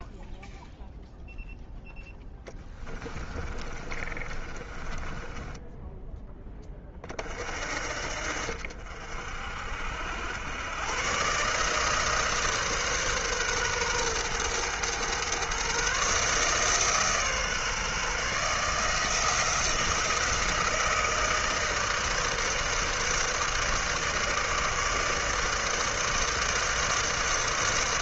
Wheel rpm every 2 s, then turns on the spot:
0, 10, 30, 10, 60, 90, 150, 110, 150, 150, 160, 150, 150, 150.
2-6